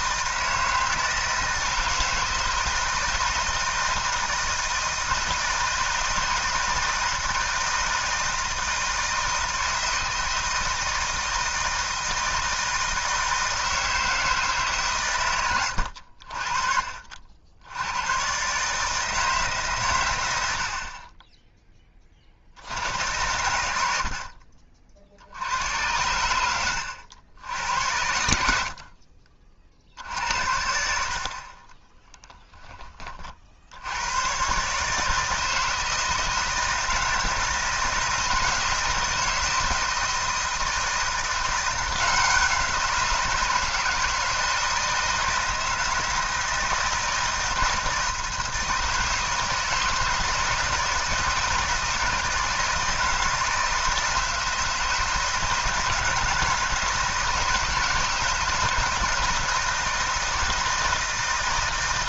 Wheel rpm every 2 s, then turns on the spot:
160, 160, 160, 160, 160, 160, 160, 140, 50, 140, 80, 70, 50, 100, 60, 60, 10, 130, 160, 160, 160, 180, 160, 160, 160, 160, 160, 160, 160, 160, 170.
none